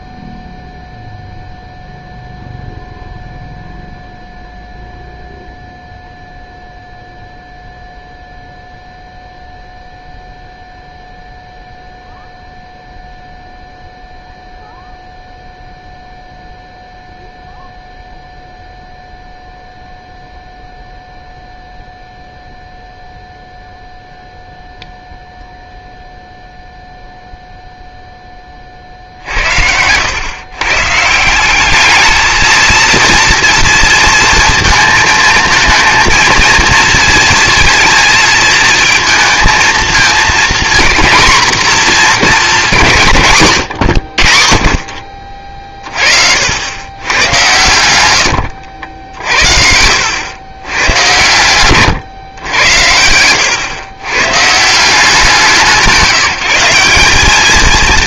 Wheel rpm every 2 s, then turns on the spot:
0, 0, 0, 0, 0, 0, 0, 0, 0, 0, 0, 0, 0, 0, 30, 130, 220, 230, 230, 230, 230, 180, 50, 80, 90, 100, 100, 150, 180.
none